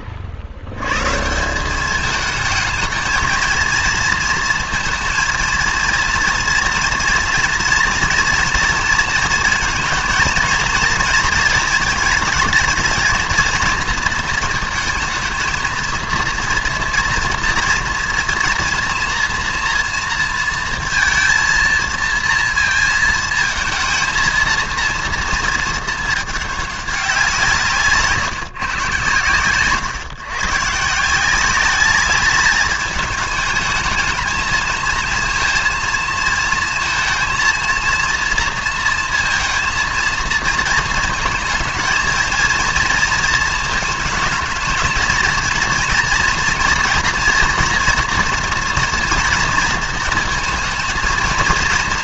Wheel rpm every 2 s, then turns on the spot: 90, 220, 230, 230, 230, 230, 210, 220, 230, 230, 230, 230, 230, 210, 130, 140, 210, 230, 220, 230, 220, 220, 220, 230, 240, 230.
none